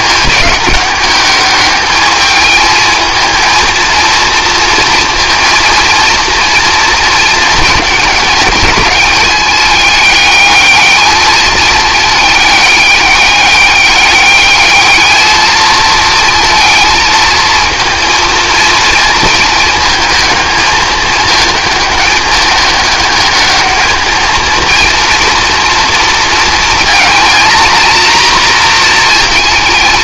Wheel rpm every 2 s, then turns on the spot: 210, 220, 230, 230, 220, 210, 210, 210, 230, 230, 210, 210, 230, 230, 240.
none